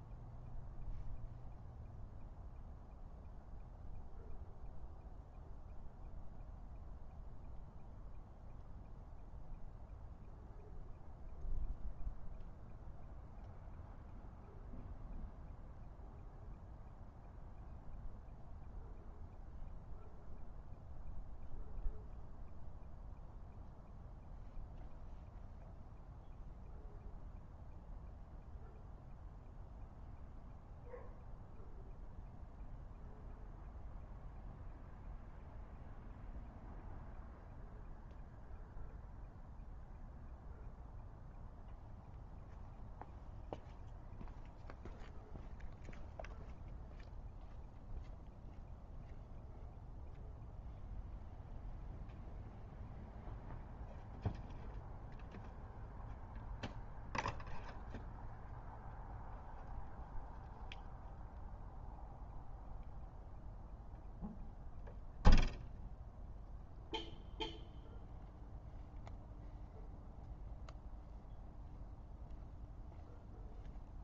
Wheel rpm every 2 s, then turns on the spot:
0, 0, 0, 0, 0, 0, 0, 0, 0, 0, 0, 0, 0, 0, 0, 0, 0, 0, 0, 0, 0, 0, 0, 0, 0, 0, 0, 0, 0, 0, 0, 0, 0, 0, 0, 0, 0.
none